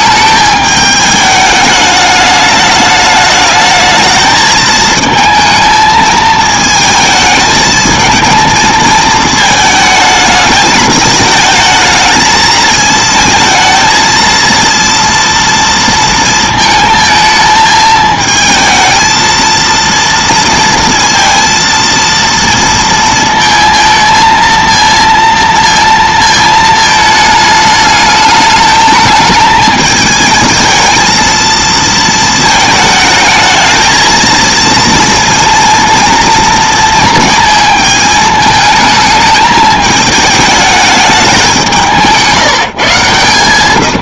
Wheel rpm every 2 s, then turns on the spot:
210, 210, 220, 220, 220, 220, 220, 230, 230, 220, 230, 230, 230, 220, 210, 220, 220, 230, 230, 220, 210, 150.
none